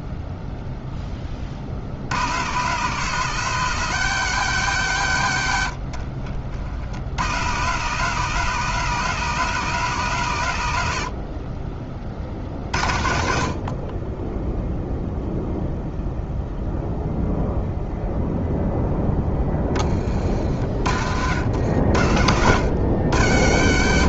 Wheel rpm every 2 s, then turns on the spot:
0, 120, 130, 60, 150, 90, 50, 0, 0, 0, 50, 90.
none